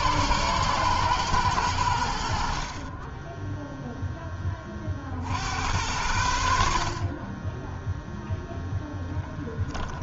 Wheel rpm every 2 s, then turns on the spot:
120, 40, 20, 60, 0.
none